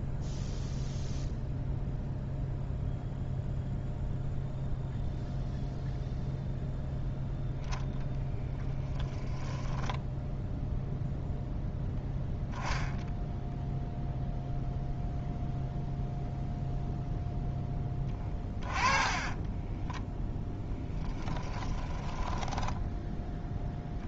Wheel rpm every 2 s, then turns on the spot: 0, 0, 0, 0, 10, 0, 10, 0, 0, 20, 10, 10.
18-24